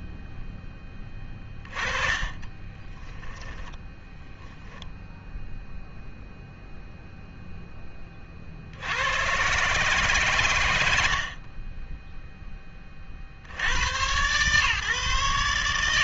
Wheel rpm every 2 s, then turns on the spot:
10, 20, 0, 0, 60, 100, 20, 130.
2-4